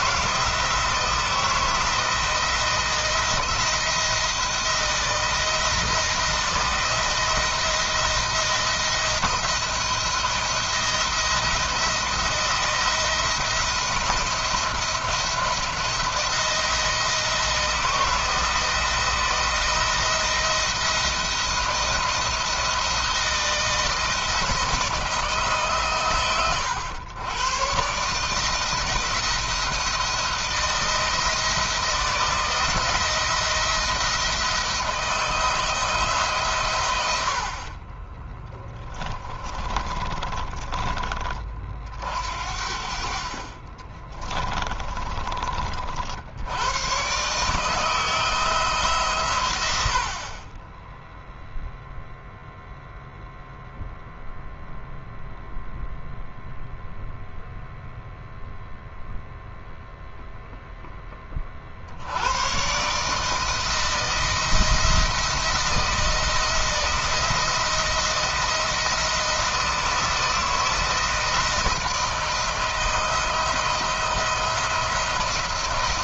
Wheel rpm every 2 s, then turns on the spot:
160, 160, 170, 170, 170, 170, 170, 170, 170, 170, 170, 170, 160, 100, 170, 170, 160, 160, 90, 20, 20, 60, 30, 120, 140, 0, 0, 0, 0, 0, 20, 150, 170, 160, 170, 160, 160, 160.
38-40 44-46